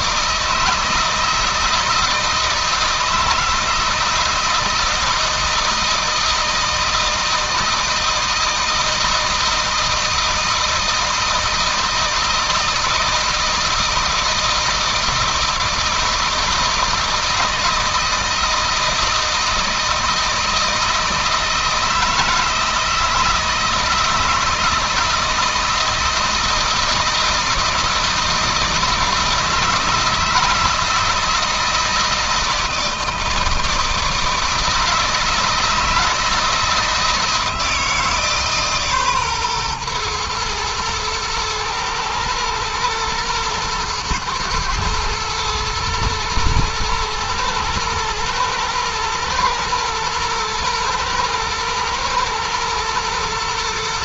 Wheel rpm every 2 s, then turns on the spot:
160, 160, 160, 160, 160, 160, 160, 160, 160, 170, 160, 160, 160, 160, 160, 160, 160, 160, 160, 140, 110, 110, 110, 110, 120, 120, 120.
none